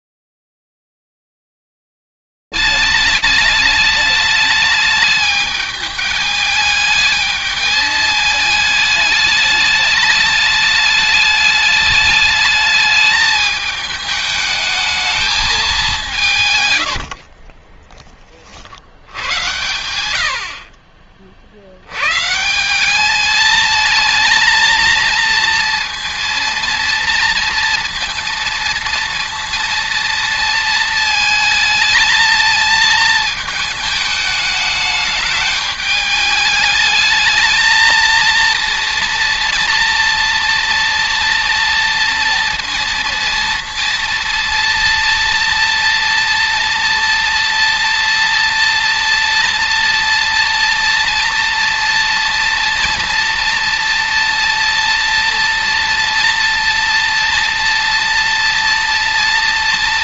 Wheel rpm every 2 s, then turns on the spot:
90, 210, 210, 210, 210, 210, 210, 210, 210, 40, 90, 100, 220, 230, 230, 230, 220, 220, 210, 220, 230, 230, 230, 230, 230, 230, 230, 230, 230, 230.
18-20